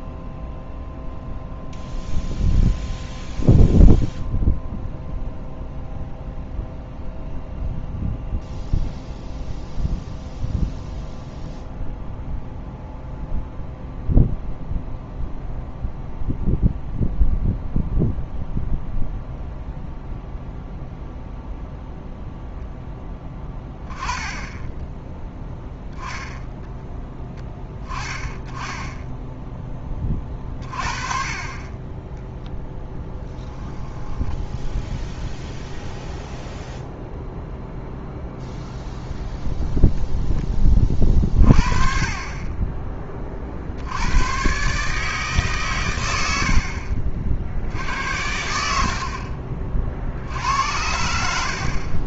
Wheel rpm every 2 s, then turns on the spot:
0, 0, 0, 0, 0, 0, 0, 0, 0, 0, 0, 0, 10, 0, 20, 30, 0, 0, 0, 0, 10, 20, 130, 70, 70, 70.
46-48